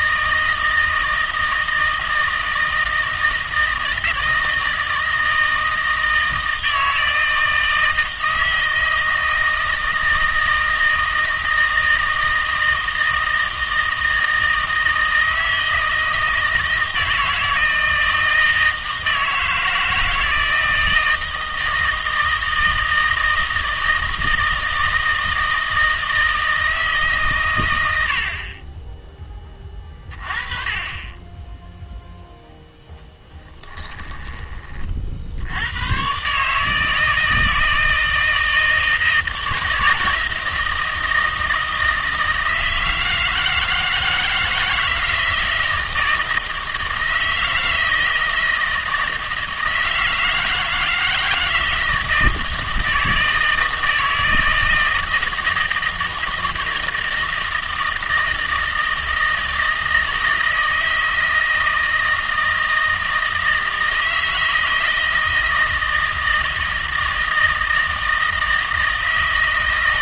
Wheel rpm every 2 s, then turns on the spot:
160, 160, 160, 160, 160, 160, 160, 160, 160, 160, 160, 160, 160, 160, 20, 20, 10, 30, 160, 160, 160, 160, 160, 160, 160, 160, 160, 160, 160, 160, 160, 160, 160, 160, 160.
none